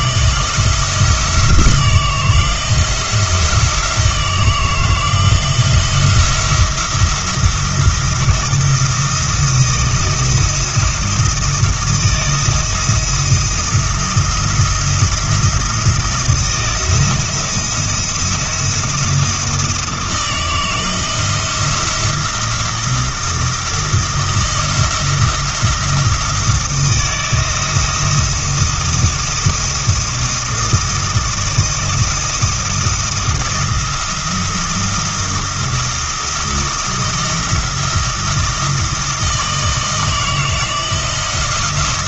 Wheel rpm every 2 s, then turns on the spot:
170, 170, 160, 170, 170, 170, 170, 170, 160, 170, 160, 170, 170, 160, 170, 170, 170, 170, 170, 170, 160.
none